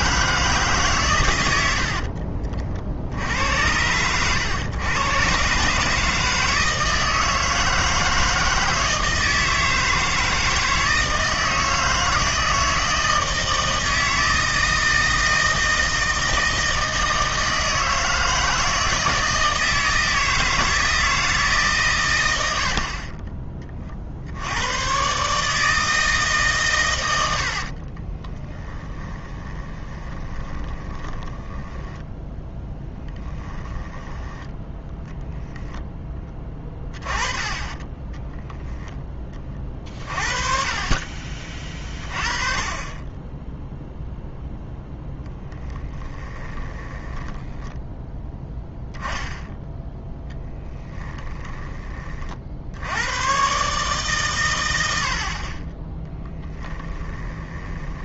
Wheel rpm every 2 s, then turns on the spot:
150, 50, 110, 160, 160, 160, 160, 160, 160, 160, 160, 70, 110, 130, 20, 20, 10, 10, 20, 0, 30, 20, 0, 20, 10, 10, 70, 90, 10.
28-34 36-38 46-48 50-52 56-58